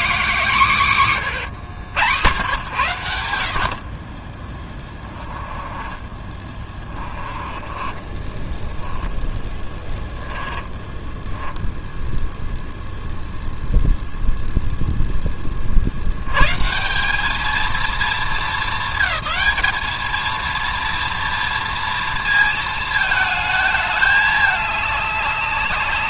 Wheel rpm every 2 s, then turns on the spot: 220, 110, 20, 20, 10, 10, 0, 0, 170, 220, 230, 220, 210.
4-12